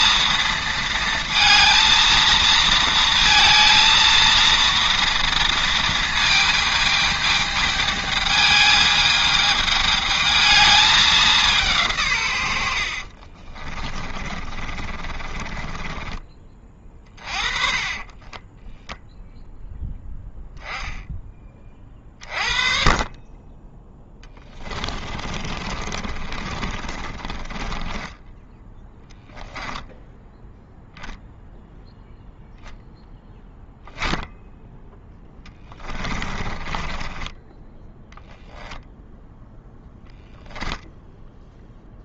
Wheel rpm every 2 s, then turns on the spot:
230, 230, 230, 220, 220, 220, 60, 30, 30, 0, 10, 30, 20, 40, 10, 0, 0, 10, 20, 0, 0.
12-18 24-30 36-38